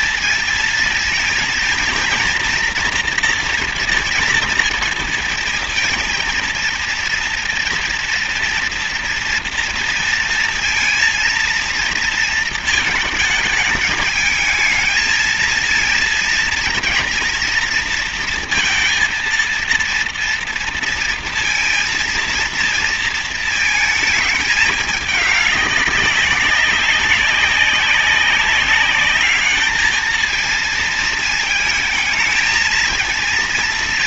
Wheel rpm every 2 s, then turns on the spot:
230, 240, 230, 230, 230, 230, 220, 220, 220, 230, 230, 230, 210, 190, 200, 220, 220.
none